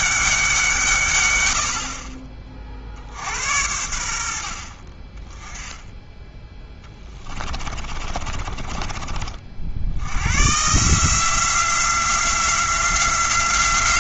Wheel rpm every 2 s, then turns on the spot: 170, 40, 50, 10, 30, 140, 180.
6-10